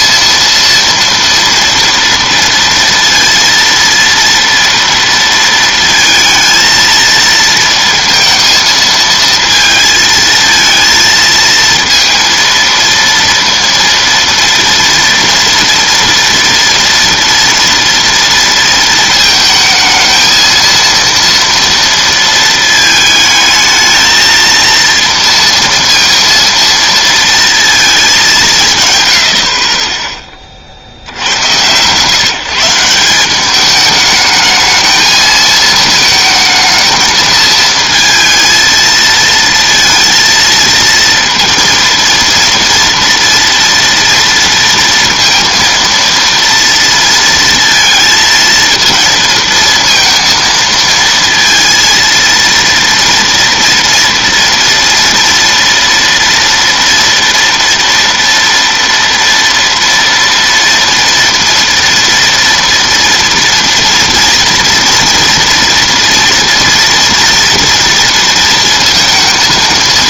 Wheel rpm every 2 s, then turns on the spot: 230, 230, 230, 230, 220, 220, 230, 230, 230, 230, 220, 220, 230, 230, 160, 50, 160, 220, 220, 230, 230, 230, 230, 230, 230, 230, 230, 230, 230, 230, 230, 230, 230, 230, 230.
none